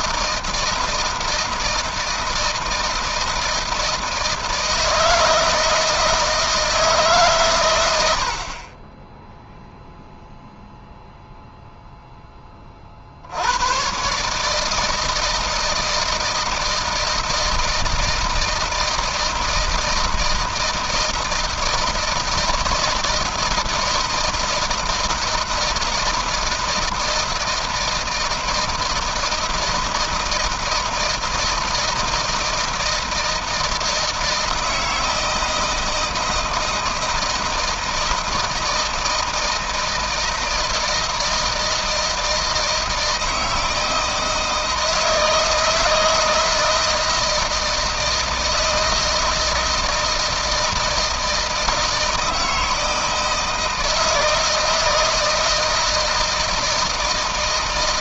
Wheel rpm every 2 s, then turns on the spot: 160, 160, 160, 160, 60, 0, 10, 130, 160, 160, 160, 170, 160, 160, 160, 160, 160, 160, 160, 160, 160, 160, 160, 160, 160, 160, 160, 160, 170.
none